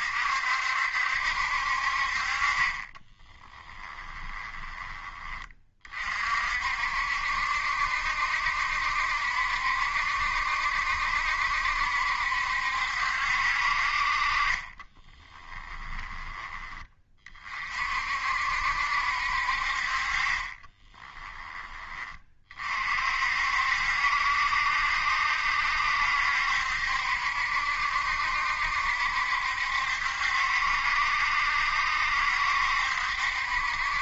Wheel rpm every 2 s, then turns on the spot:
70, 30, 20, 60, 70, 70, 70, 20, 20, 60, 20, 50, 70, 70, 70, 70, 70.
2-4 14-16 20-22